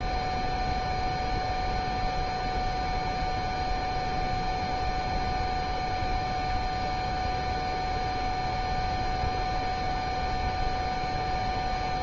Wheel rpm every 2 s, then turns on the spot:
0, 0, 0, 0, 0, 0.
none